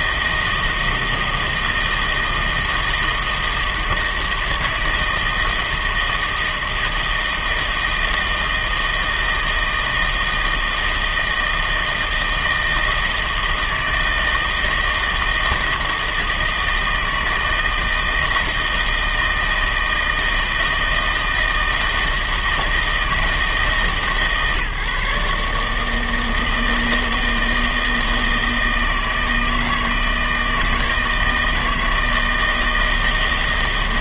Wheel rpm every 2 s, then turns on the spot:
160, 160, 160, 160, 160, 160, 160, 160, 160, 160, 160, 160, 140, 160, 160, 160, 160.
none